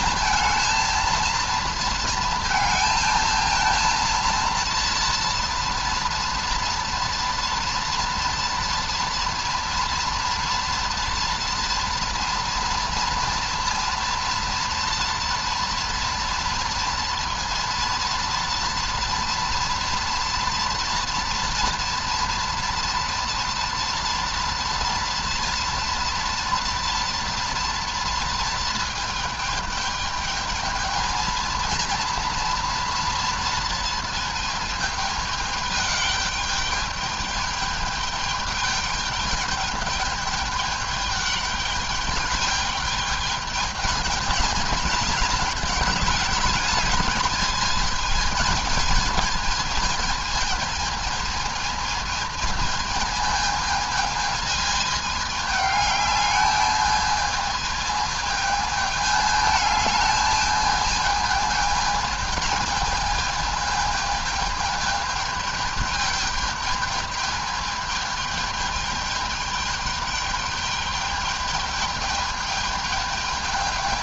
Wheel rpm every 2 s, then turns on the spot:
220, 220, 230, 230, 230, 230, 230, 240, 230, 230, 230, 240, 230, 230, 220, 210, 230, 220, 210, 210, 210, 210, 220, 210, 220, 220, 220, 220, 210, 220, 220, 210, 210, 220, 210, 210, 210.
none